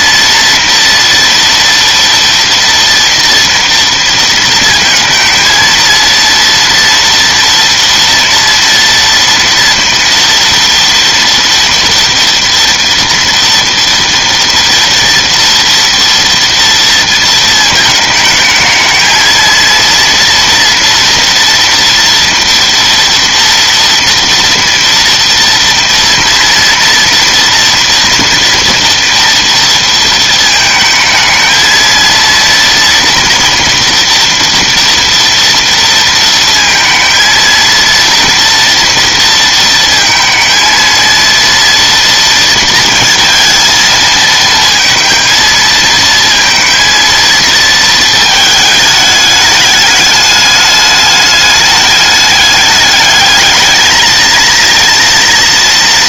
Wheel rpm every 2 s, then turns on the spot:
230, 230, 220, 230, 230, 230, 240, 230, 230, 220, 240, 230, 230, 230, 230, 220, 230, 230, 230, 230, 230, 230, 230, 230, 220, 210, 210, 230.
none